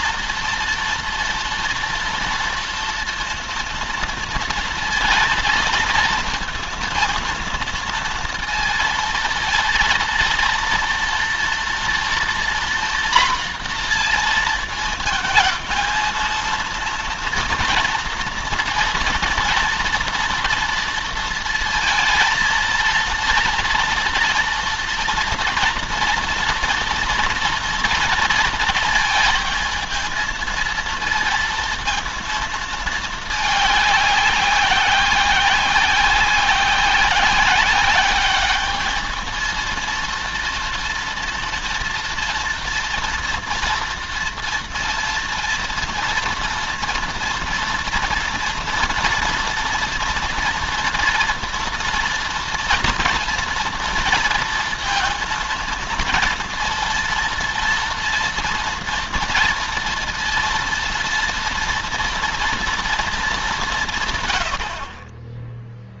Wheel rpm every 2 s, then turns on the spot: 230, 230, 230, 230, 230, 230, 240, 230, 230, 230, 230, 230, 230, 240, 230, 220, 220, 190, 180, 210, 230, 230, 230, 230, 230, 240, 230, 230, 230, 230, 230, 230, 70.
none